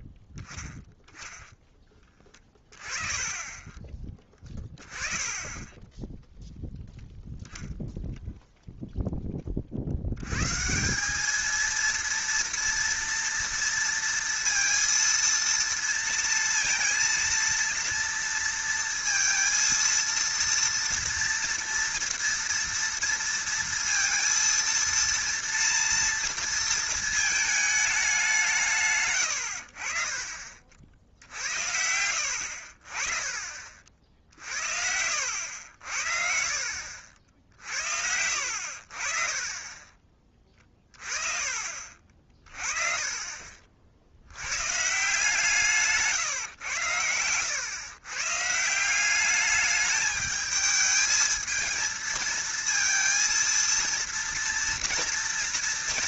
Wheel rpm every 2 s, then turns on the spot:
0, 20, 20, 0, 0, 160, 230, 230, 230, 230, 230, 230, 230, 230, 150, 50, 70, 60, 60, 60, 20, 30, 120, 110, 150, 220, 220, 230.
4-6 34-36 40-42